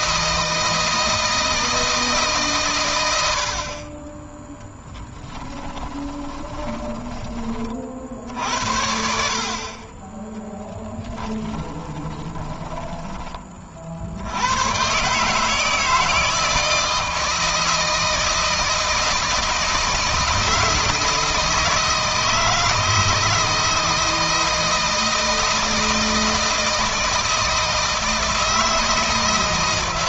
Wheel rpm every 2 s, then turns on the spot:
160, 100, 10, 20, 60, 10, 20, 120, 160, 160, 160, 160, 160, 160, 160.
10-14